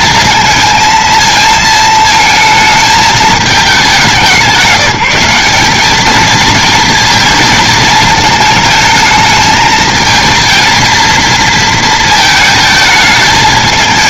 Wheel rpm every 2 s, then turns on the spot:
230, 220, 190, 230, 220, 230, 220.
none